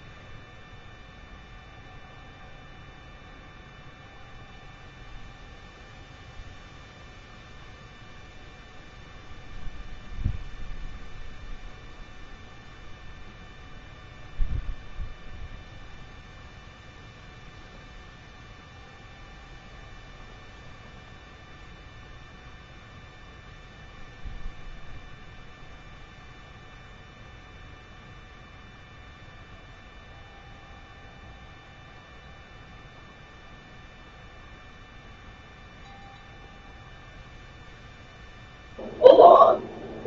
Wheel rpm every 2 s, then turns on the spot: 0, 0, 0, 0, 0, 0, 0, 0, 0, 0, 0, 0, 0, 0, 0, 0, 0, 0, 0, 0.
none